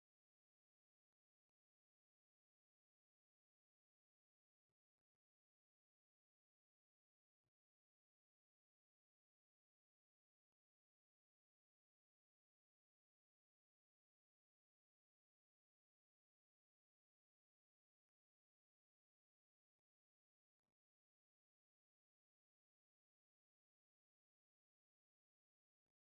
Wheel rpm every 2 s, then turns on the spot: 0, 0, 0, 0, 0, 0, 0, 0, 0, 0, 0, 0, 0.
none